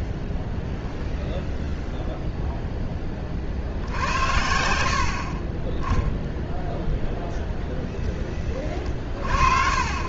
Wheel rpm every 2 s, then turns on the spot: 0, 40, 40, 0, 50.
none